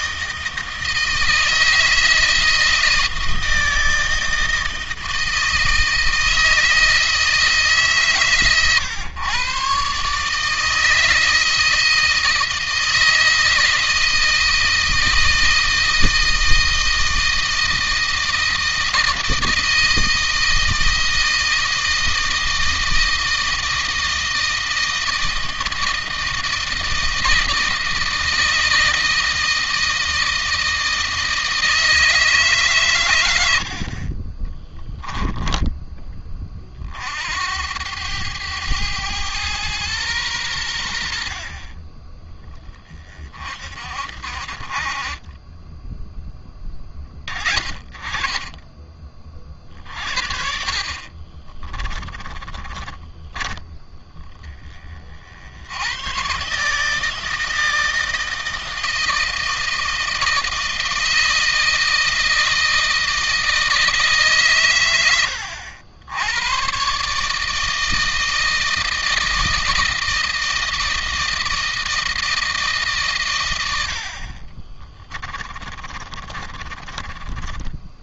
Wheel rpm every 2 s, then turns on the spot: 160, 160, 160, 160, 120, 160, 160, 160, 160, 160, 160, 160, 160, 160, 160, 160, 130, 10, 40, 110, 90, 30, 40, 20, 30, 50, 30, 30, 140, 160, 160, 160, 120, 130, 160, 160, 150, 30, 20.
34-36 50-54 74-78